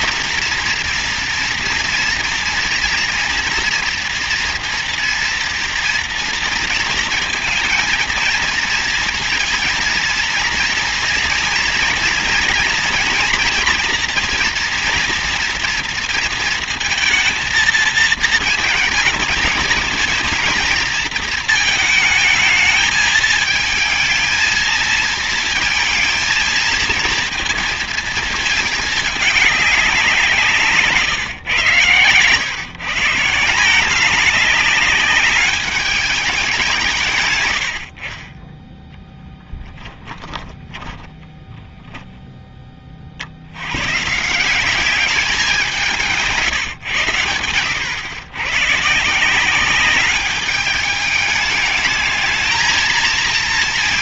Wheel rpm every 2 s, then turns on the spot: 230, 240, 230, 230, 230, 230, 230, 230, 220, 230, 230, 220, 220, 230, 210, 170, 140, 200, 170, 10, 10, 20, 190, 140, 140, 200, 220.
40-42